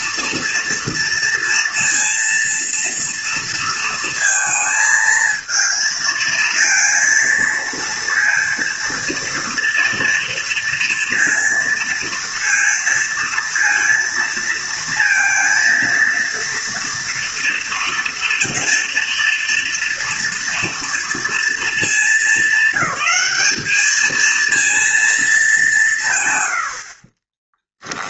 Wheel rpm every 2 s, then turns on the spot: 230, 230, 230, 230, 230, 230, 230, 230, 230, 230, 240, 210, 230, 40.
26-28